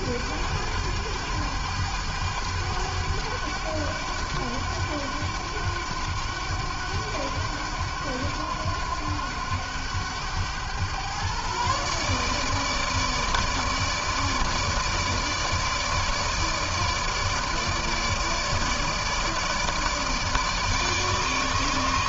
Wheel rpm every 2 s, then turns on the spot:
100, 100, 100, 100, 100, 110, 150, 160, 150, 150, 150.
none